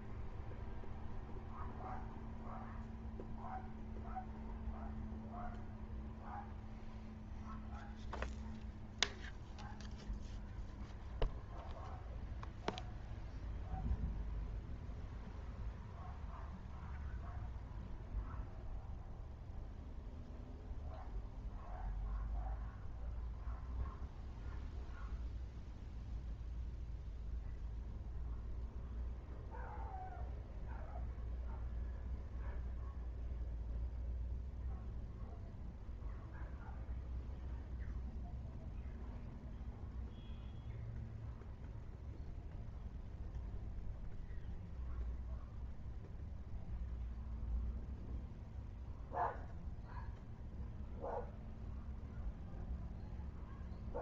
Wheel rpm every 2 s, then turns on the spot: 0, 0, 0, 0, 0, 0, 0, 0, 0, 0, 0, 0, 0, 0, 0, 0, 0, 0, 0, 0, 0, 0, 0, 0, 0, 0, 0.
none